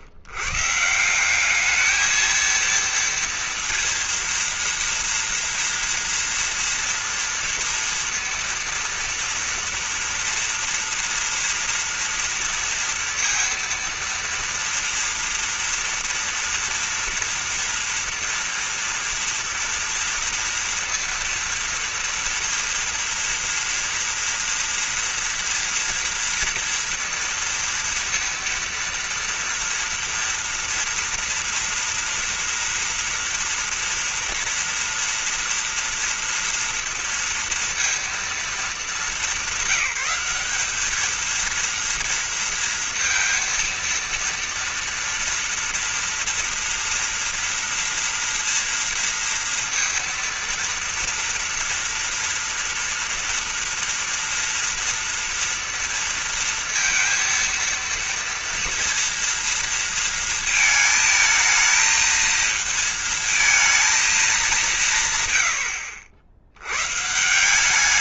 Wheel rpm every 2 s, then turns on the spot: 170, 230, 230, 230, 230, 230, 230, 230, 230, 230, 240, 230, 230, 230, 230, 230, 230, 230, 240, 210, 200, 230, 230, 230, 230, 230, 230, 230, 230, 230, 220, 220, 170, 110.
none